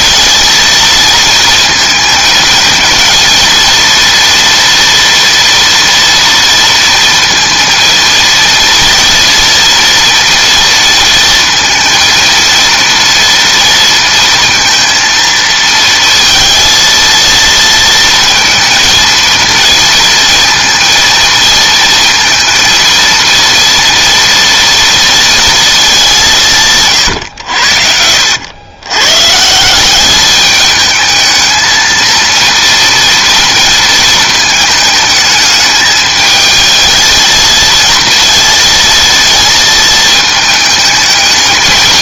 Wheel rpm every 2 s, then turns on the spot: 230, 230, 240, 230, 230, 230, 230, 230, 230, 220, 230, 230, 230, 150, 110, 210, 230, 220, 220, 230, 210.
none